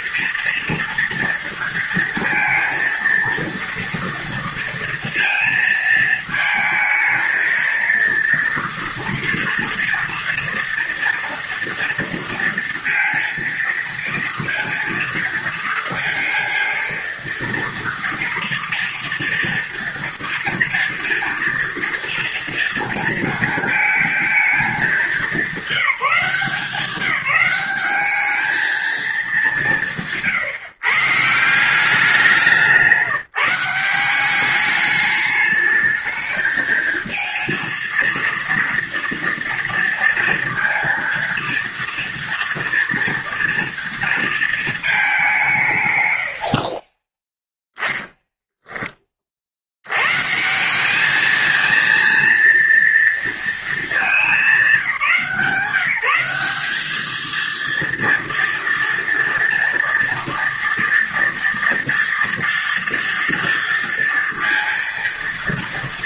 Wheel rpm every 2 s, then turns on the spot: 230, 230, 230, 220, 230, 230, 230, 230, 230, 230, 230, 230, 220, 170, 210, 140, 180, 200, 220, 230, 230, 230, 230, 80, 10, 160, 230, 210, 190, 230, 230, 230, 230.
46-50